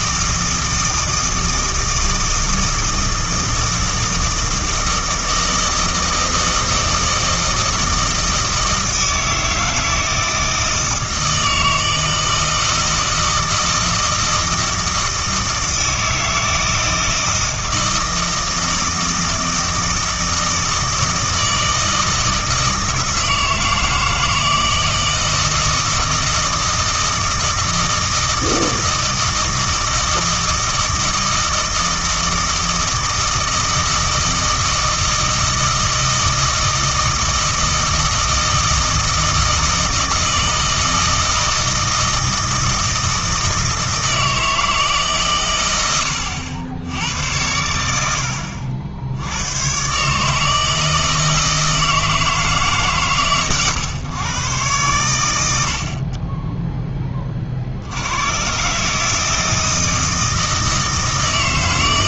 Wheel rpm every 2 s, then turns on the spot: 160, 160, 160, 160, 160, 160, 160, 160, 160, 160, 160, 160, 160, 160, 160, 160, 160, 160, 160, 160, 160, 160, 160, 90, 70, 160, 150, 120, 10, 130, 160.
none